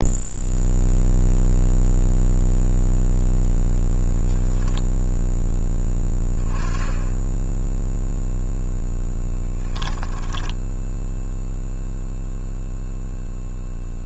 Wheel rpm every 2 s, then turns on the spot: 0, 0, 0, 10, 0, 0, 0.
none